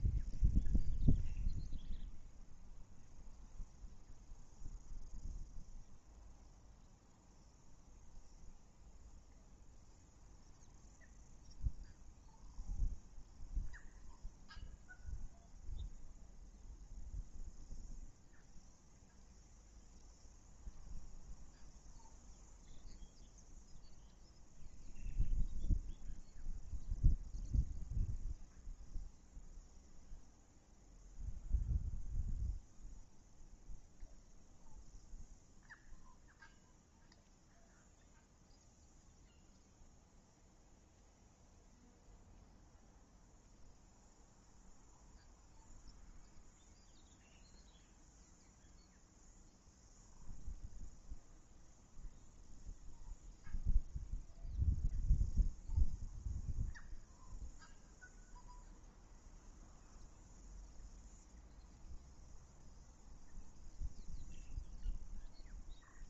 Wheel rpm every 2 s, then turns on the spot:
0, 0, 0, 0, 0, 0, 0, 0, 0, 0, 0, 0, 0, 0, 0, 0, 0, 0, 0, 0, 0, 0, 0, 0, 0, 0, 0, 0, 0, 0, 0, 0, 0.
none